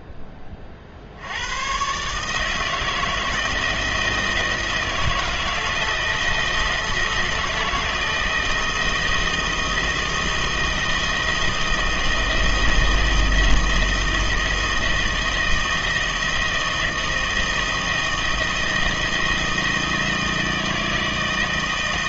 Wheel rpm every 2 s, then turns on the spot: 40, 160, 160, 160, 160, 170, 160, 160, 160, 160, 160.
none